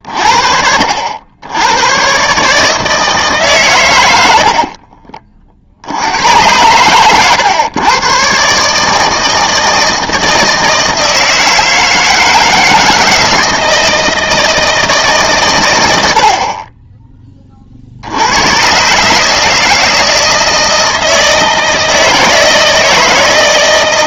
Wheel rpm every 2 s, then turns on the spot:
60, 150, 50, 110, 150, 160, 160, 160, 30, 120, 160, 160.
4-6